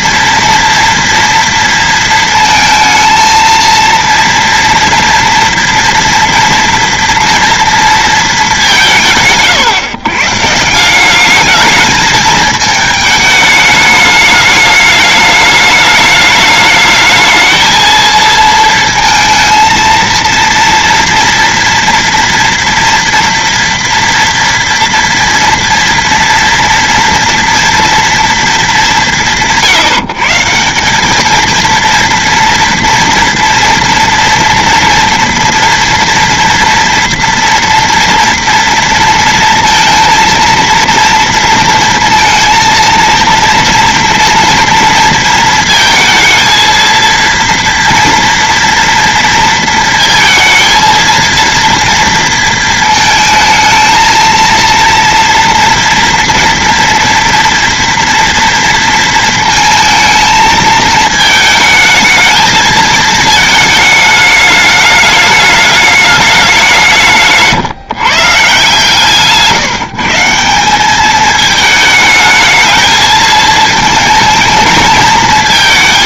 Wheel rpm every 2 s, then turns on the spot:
230, 220, 230, 240, 140, 170, 210, 210, 210, 230, 230, 230, 240, 230, 210, 180, 230, 240, 230, 230, 230, 230, 230, 230, 230, 230, 220, 230, 230, 230, 220, 220, 210, 180, 140, 190, 220, 230.
none